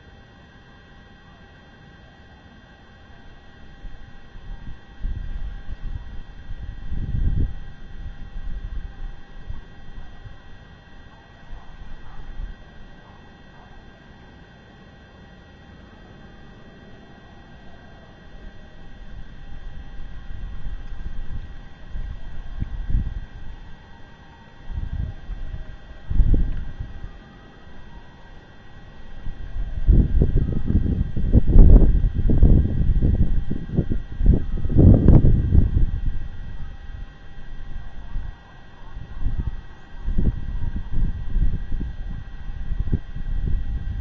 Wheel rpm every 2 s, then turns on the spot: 0, 0, 0, 0, 0, 0, 0, 0, 0, 0, 0, 0, 0, 0, 0, 0, 0, 0, 0, 0, 0, 0.
none